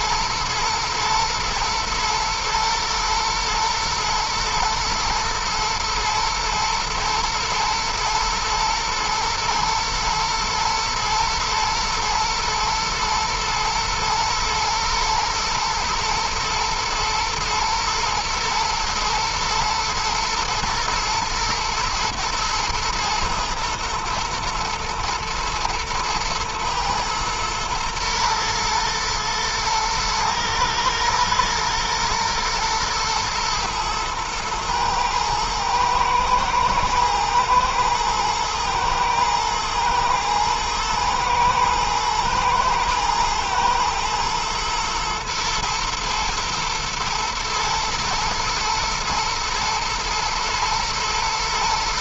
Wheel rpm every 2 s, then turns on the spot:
120, 110, 110, 110, 120, 120, 120, 120, 110, 110, 120, 110, 110, 110, 120, 110, 120, 120, 120, 120, 110, 110, 120, 120, 120, 110.
none